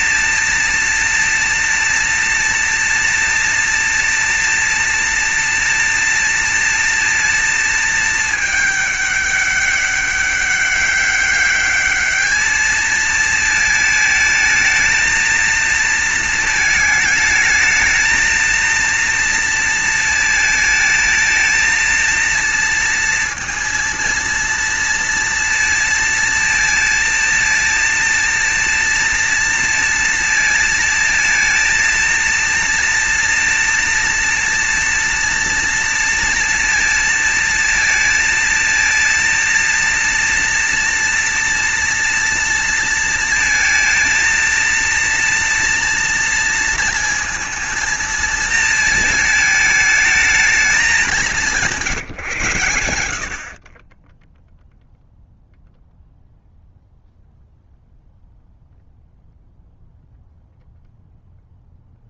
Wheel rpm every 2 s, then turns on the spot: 230, 230, 230, 230, 210, 200, 220, 220, 220, 230, 220, 230, 230, 230, 230, 230, 230, 230, 230, 230, 230, 230, 230, 230, 230, 200, 110, 0, 0, 0, 0.
none